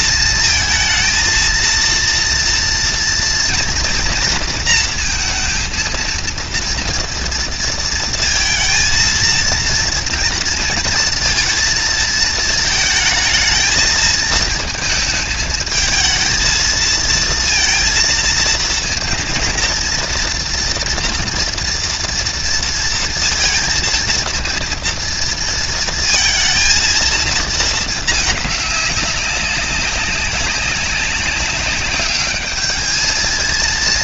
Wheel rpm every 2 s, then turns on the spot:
230, 240, 230, 230, 230, 230, 220, 220, 220, 230, 230, 230, 230, 230, 200, 190, 220.
none